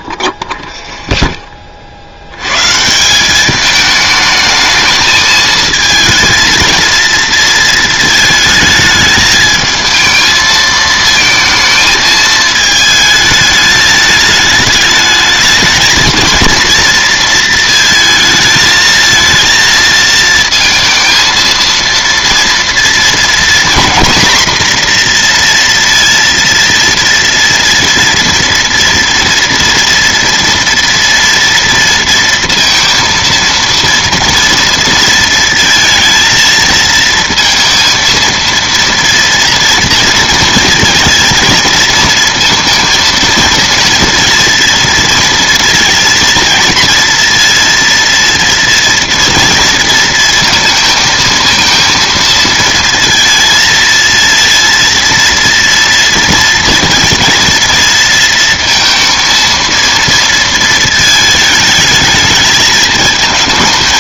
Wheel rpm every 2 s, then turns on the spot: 10, 140, 220, 230, 220, 220, 220, 210, 230, 220, 220, 230, 240, 230, 230, 230, 230, 230, 230, 230, 230, 230, 230, 230, 230, 220, 230, 230, 230, 230, 220, 220.
0-2